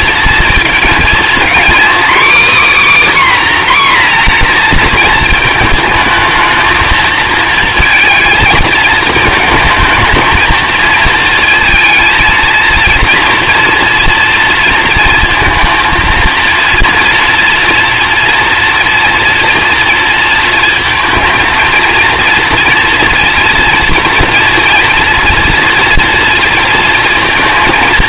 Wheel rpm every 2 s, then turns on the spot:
230, 280, 230, 220, 220, 220, 230, 230, 230, 230, 230, 230, 230, 230.
none